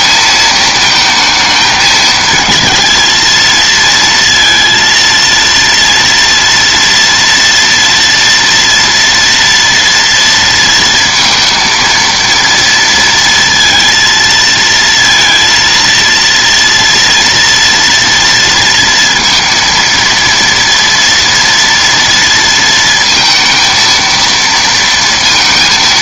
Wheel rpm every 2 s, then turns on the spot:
220, 230, 230, 230, 240, 230, 230, 230, 230, 230, 240, 230, 230.
none